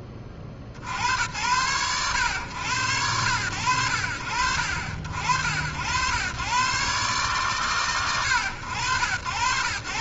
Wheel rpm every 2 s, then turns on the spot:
60, 100, 70, 130, 90.
none